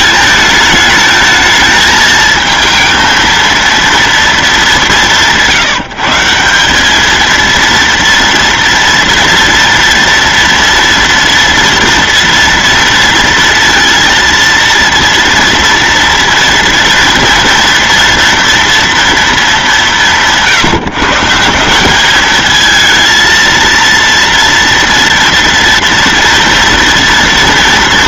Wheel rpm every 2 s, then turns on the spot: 220, 230, 180, 220, 230, 240, 230, 230, 230, 230, 160, 230, 230, 230.
none